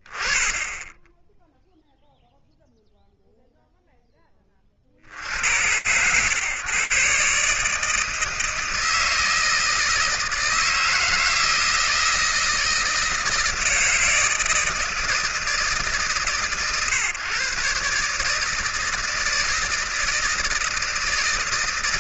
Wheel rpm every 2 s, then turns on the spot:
10, 0, 40, 130, 160, 160, 160, 160, 140, 160, 160.
none